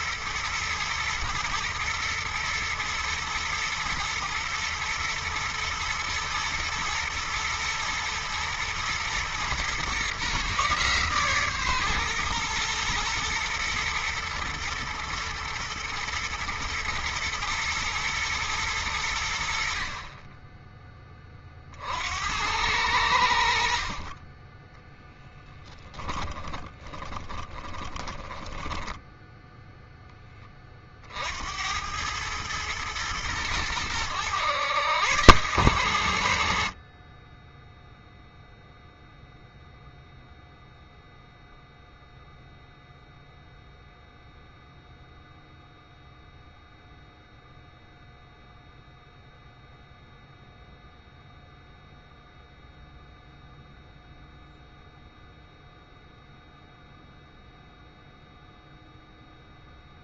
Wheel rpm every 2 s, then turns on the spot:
110, 110, 110, 120, 110, 140, 110, 110, 110, 100, 20, 80, 10, 20, 10, 40, 110, 110, 50, 0, 0, 0, 0, 0, 0, 0, 0, 0, 0, 0.
24-28